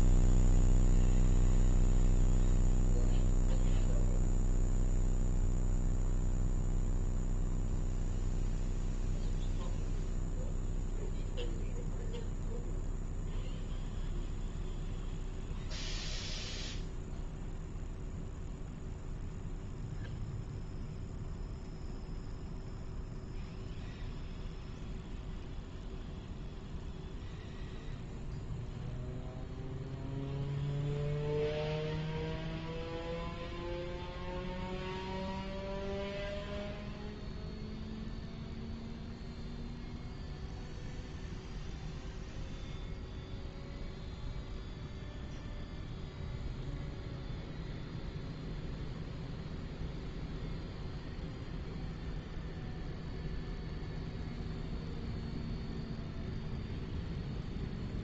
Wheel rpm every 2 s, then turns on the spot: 0, 0, 0, 0, 0, 0, 0, 0, 0, 0, 0, 0, 0, 0, 0, 0, 0, 0, 0, 0, 0, 0, 0, 0, 0, 0, 0, 0, 0.
none